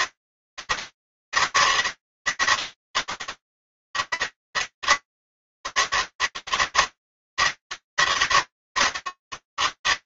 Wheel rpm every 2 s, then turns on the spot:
190, 190, 200, 200, 200.
none